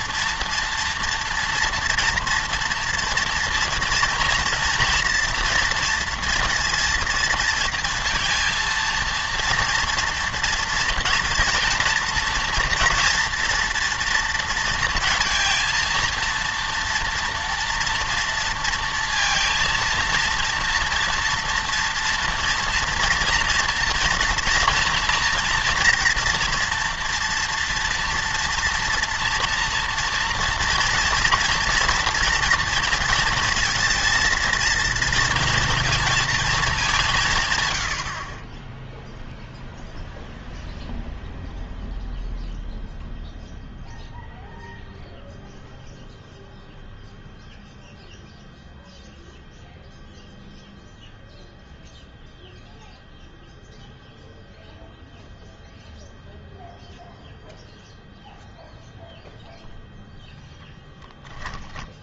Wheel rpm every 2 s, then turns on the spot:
230, 230, 230, 230, 230, 240, 230, 230, 230, 230, 230, 230, 230, 240, 230, 240, 230, 230, 210, 10, 0, 0, 0, 0, 0, 0, 0, 0, 0, 0, 0.
none